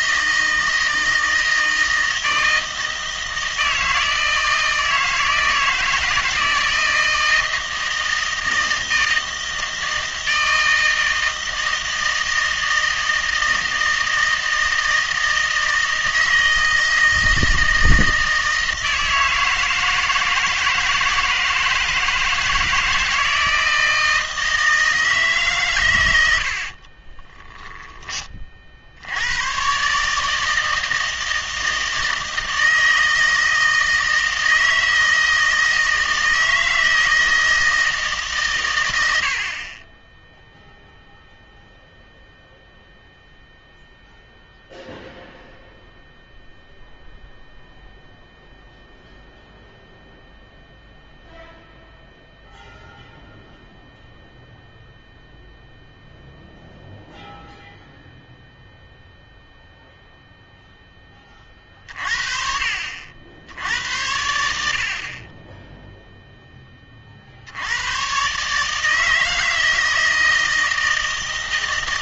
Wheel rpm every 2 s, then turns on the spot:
160, 160, 160, 160, 160, 160, 160, 160, 160, 160, 160, 160, 160, 50, 50, 160, 160, 160, 160, 110, 0, 0, 0, 0, 0, 0, 0, 0, 0, 0, 10, 50, 60, 20, 150, 160.
26-28